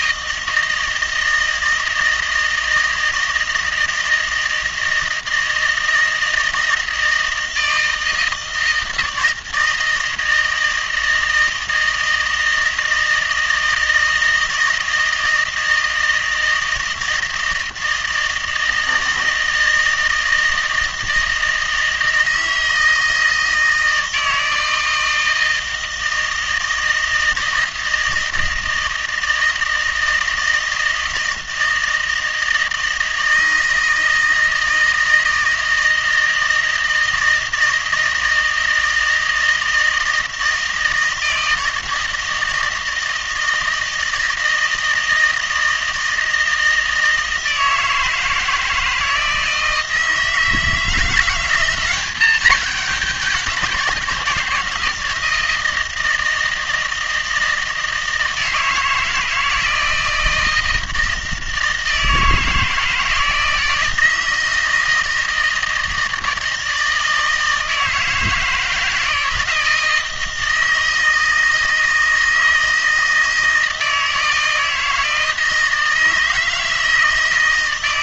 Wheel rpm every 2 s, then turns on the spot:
160, 160, 160, 160, 160, 160, 160, 160, 160, 160, 160, 160, 160, 160, 160, 160, 160, 160, 160, 160, 160, 160, 160, 160, 160, 160, 210, 160, 160, 160, 160, 160, 160, 160, 160, 160, 160, 160, 160.
none